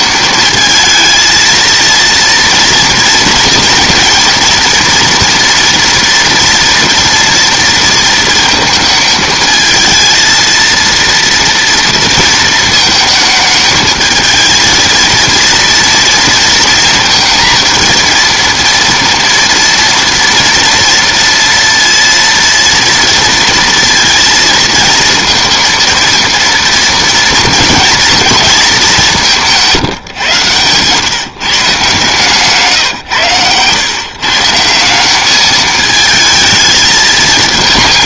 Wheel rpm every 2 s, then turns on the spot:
220, 230, 230, 230, 230, 230, 220, 220, 230, 230, 230, 230, 230, 230, 220, 120, 140, 170, 220.
none